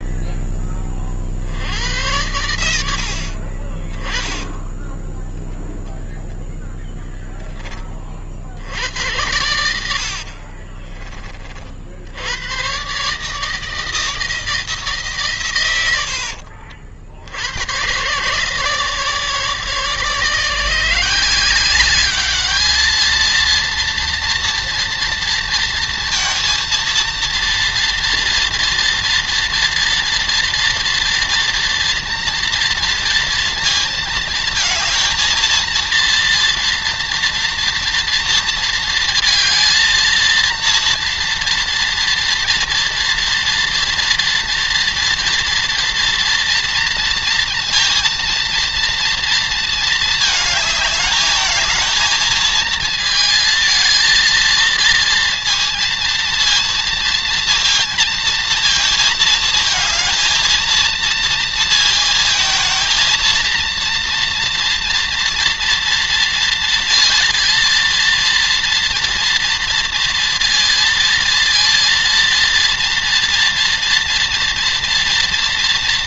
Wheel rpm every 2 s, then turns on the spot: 20, 90, 10, 10, 70, 40, 110, 160, 60, 140, 160, 210, 230, 230, 230, 230, 230, 230, 230, 230, 230, 240, 230, 230, 230, 220, 220, 230, 230, 230, 230, 230, 230, 230, 230, 230, 230, 240.
4-8 10-12